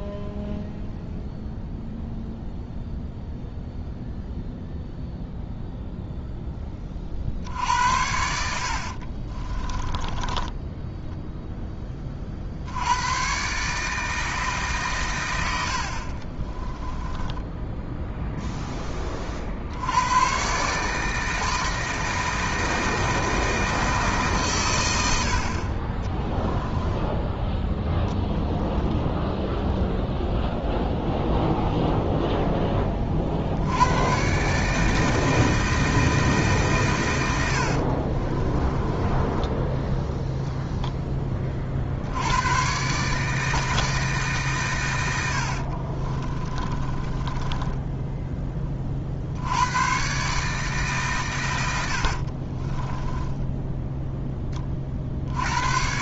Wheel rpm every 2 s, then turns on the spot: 0, 0, 0, 30, 50, 10, 80, 130, 20, 20, 150, 160, 100, 10, 10, 0, 10, 150, 120, 20, 10, 130, 120, 20, 40, 140, 20, 30.
8-12 16-18 26-30 38-40 46-48 52-54